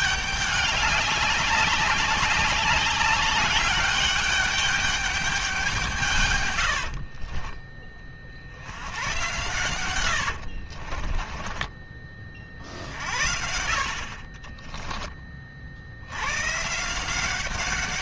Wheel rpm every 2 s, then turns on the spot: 200, 210, 200, 80, 80, 60, 50, 30, 150.
6-8 10-12 14-16